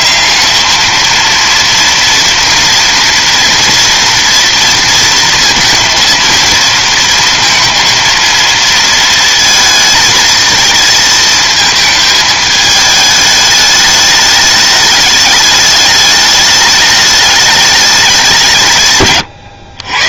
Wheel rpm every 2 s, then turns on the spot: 230, 230, 230, 230, 230, 220, 210, 210, 210, 120.
18-20